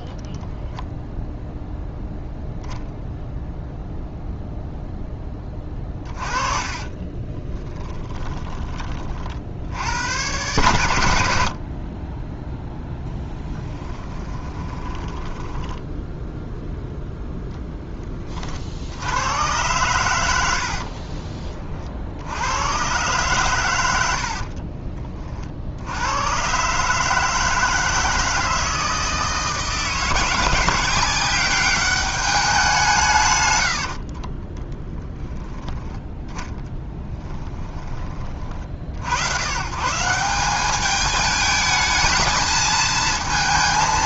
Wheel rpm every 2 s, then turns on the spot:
0, 0, 0, 30, 20, 100, 10, 10, 0, 50, 70, 100, 40, 130, 160, 180, 190, 20, 10, 50, 190, 220.
6-8 14-16 20-22 24-26 34-38